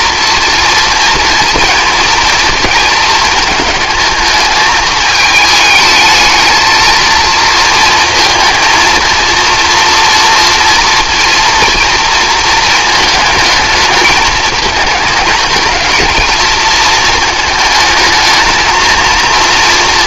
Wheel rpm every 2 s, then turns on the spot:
240, 230, 220, 220, 230, 240, 220, 220, 220, 220.
none